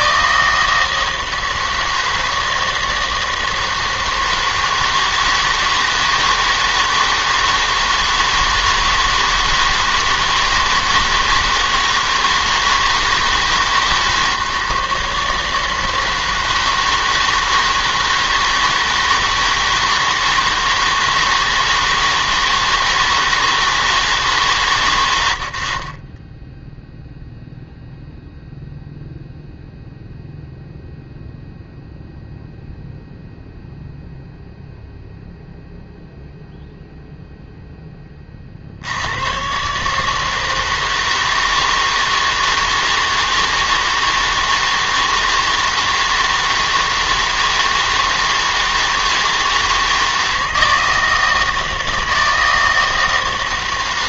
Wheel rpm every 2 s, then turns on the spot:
160, 160, 160, 160, 160, 160, 160, 150, 160, 160, 160, 160, 140, 10, 0, 0, 0, 0, 0, 50, 160, 160, 160, 160, 160, 160, 160.
none